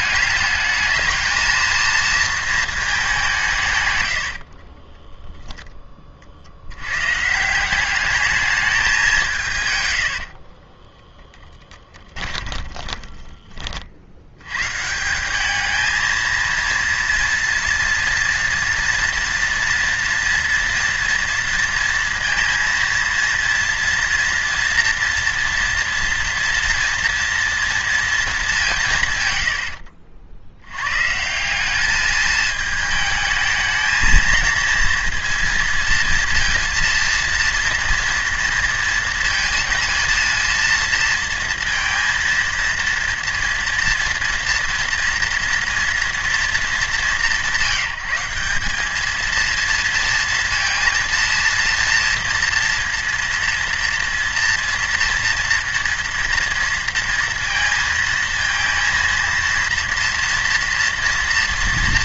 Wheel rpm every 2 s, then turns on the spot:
210, 220, 50, 70, 210, 50, 20, 100, 230, 230, 230, 230, 230, 230, 200, 90, 220, 230, 230, 230, 230, 230, 230, 210, 190, 230, 230, 230, 230, 230, 230.
4-6 10-14